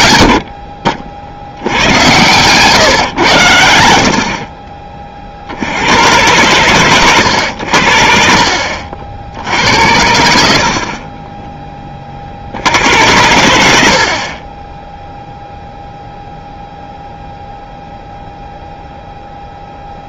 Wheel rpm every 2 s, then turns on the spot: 50, 130, 40, 110, 50, 50, 80, 10, 0, 0.
none